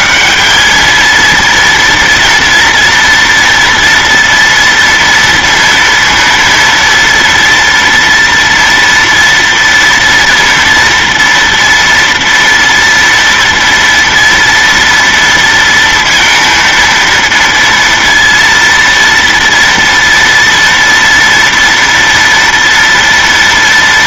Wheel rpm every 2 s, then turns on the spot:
210, 230, 230, 230, 230, 230, 230, 230, 230, 230, 230, 230.
none